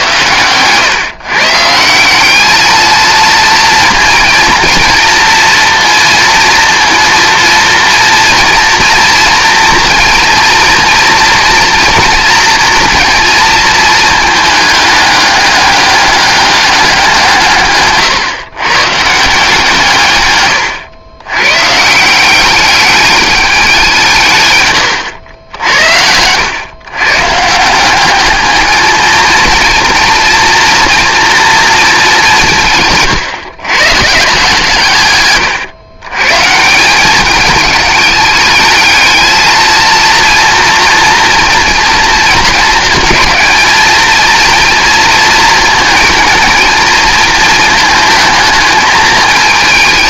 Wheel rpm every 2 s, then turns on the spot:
120, 220, 230, 230, 230, 240, 230, 210, 200, 130, 120, 200, 130, 110, 220, 230, 150, 150, 160, 210, 230, 230, 230, 230, 220.
none